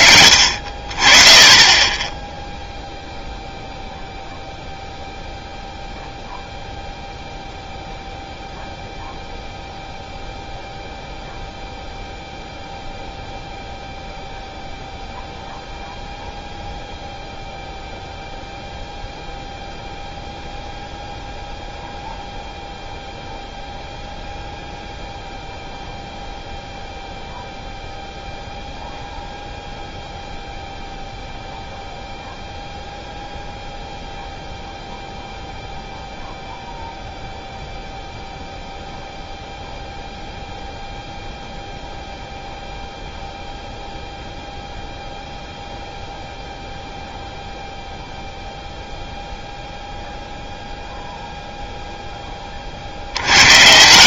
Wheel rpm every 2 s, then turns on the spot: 50, 0, 0, 0, 0, 0, 0, 0, 0, 0, 0, 0, 0, 0, 0, 0, 0, 0, 0, 0, 0, 0, 0, 0, 0, 0, 30.
none